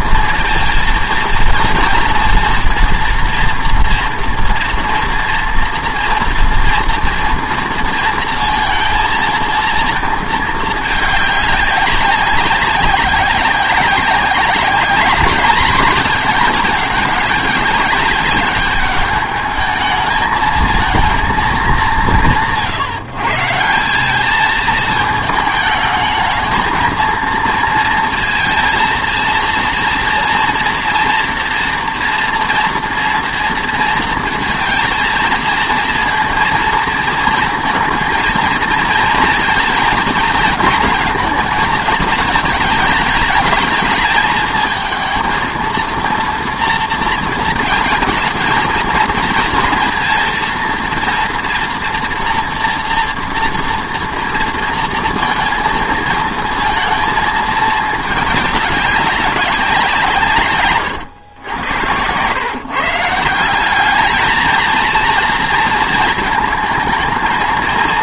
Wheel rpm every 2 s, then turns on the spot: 230, 240, 230, 230, 230, 220, 190, 200, 210, 210, 220, 130, 220, 220, 230, 230, 230, 230, 230, 230, 230, 210, 220, 230, 230, 230, 230, 230, 220, 200, 130, 140, 230, 220.
none